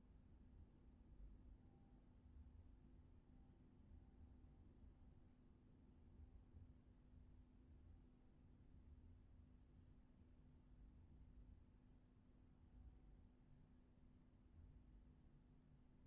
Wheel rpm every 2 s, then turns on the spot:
0, 0, 0, 0, 0, 0, 0, 0.
none